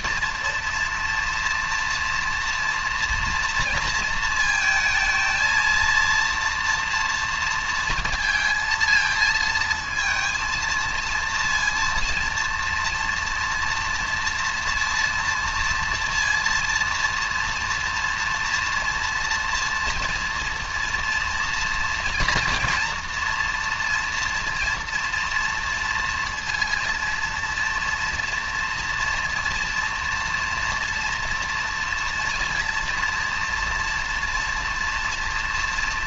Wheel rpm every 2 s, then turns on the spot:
230, 240, 230, 230, 230, 230, 230, 230, 230, 230, 230, 230, 230, 230, 230, 240, 240, 230.
none